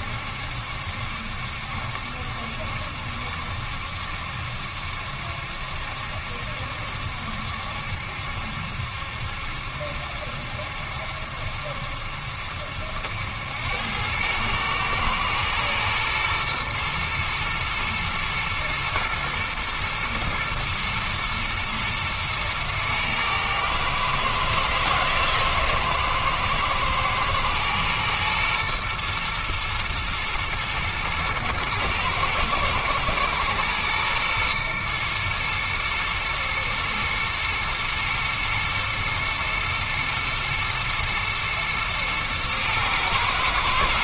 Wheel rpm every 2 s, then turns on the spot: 70, 70, 70, 70, 70, 70, 70, 110, 120, 120, 120, 110, 110, 110, 120, 110, 110, 120, 120, 110, 110, 110.
none